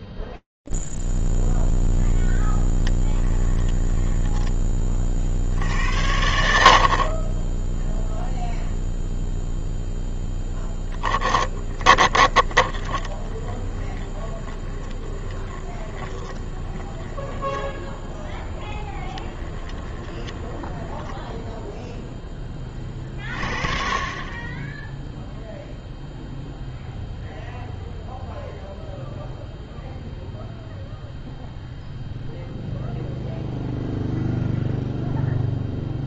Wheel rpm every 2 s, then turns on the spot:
0, 0, 10, 80, 0, 0, 30, 20, 20, 10, 10, 30, 10, 0, 0, 0, 0, 0.
4-6 12-22